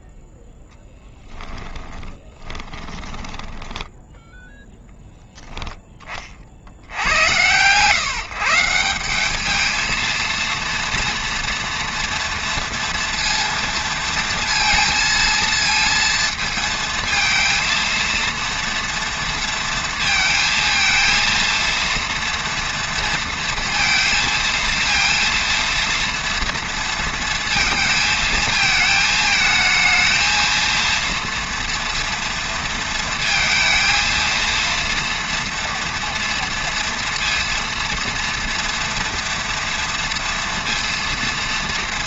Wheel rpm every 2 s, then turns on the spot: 20, 10, 20, 130, 230, 230, 230, 230, 230, 220, 230, 230, 230, 220, 220, 230, 230, 230, 230, 240, 230.
0-4